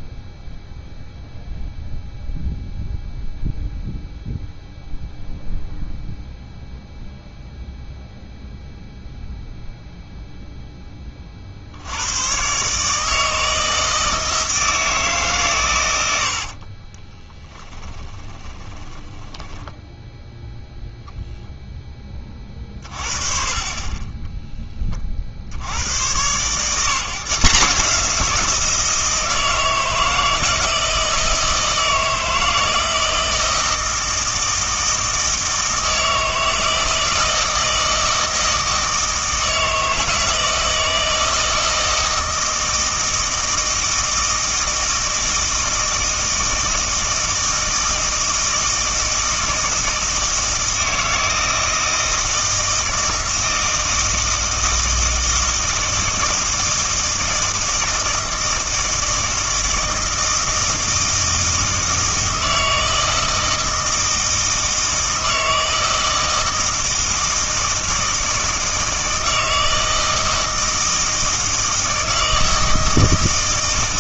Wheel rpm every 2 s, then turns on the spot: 0, 0, 0, 0, 0, 10, 140, 160, 40, 10, 0, 30, 10, 140, 170, 160, 170, 160, 160, 160, 160, 160, 160, 160, 160, 160, 160, 160, 160, 160, 160, 160, 160, 160, 160, 160, 160.
16-20